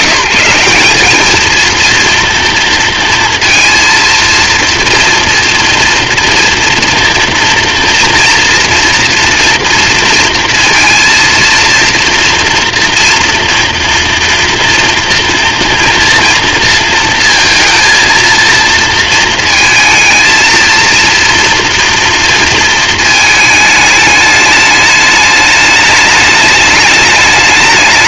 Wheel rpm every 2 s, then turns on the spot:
180, 230, 230, 240, 240, 230, 230, 230, 230, 230, 230, 220, 210, 210.
none